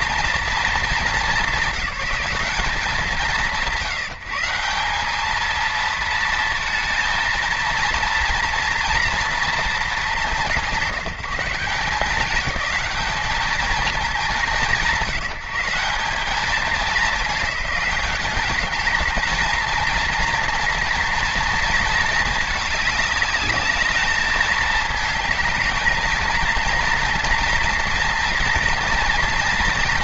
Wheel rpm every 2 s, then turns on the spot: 210, 170, 190, 230, 230, 170, 210, 140, 190, 210, 230, 210, 220, 230, 230.
none